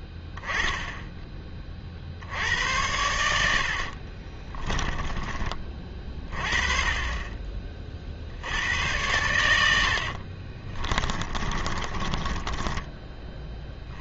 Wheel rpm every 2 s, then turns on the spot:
0, 90, 20, 20, 80, 40, 20.
4-6 10-14